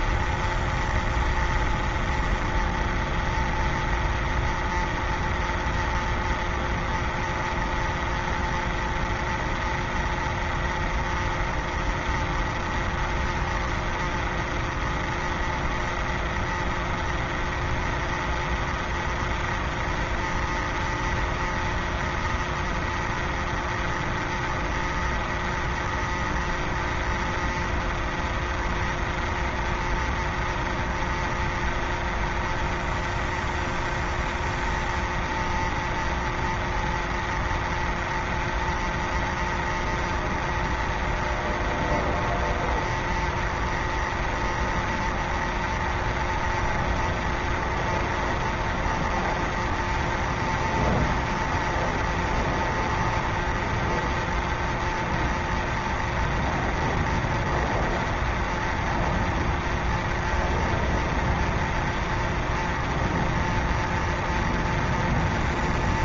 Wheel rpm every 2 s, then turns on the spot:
0, 0, 0, 0, 0, 0, 0, 0, 0, 0, 0, 0, 0, 0, 0, 0, 0, 0, 0, 0, 0, 0, 0, 0, 0, 0, 0, 0, 0, 0, 0, 0, 0.
none